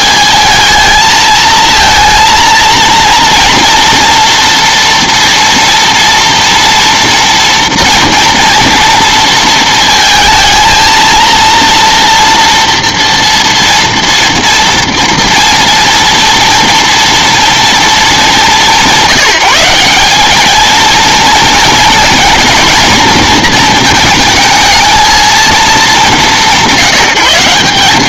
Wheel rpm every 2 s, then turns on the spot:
220, 230, 240, 240, 230, 220, 230, 230, 230, 180, 220, 220, 220, 160.
none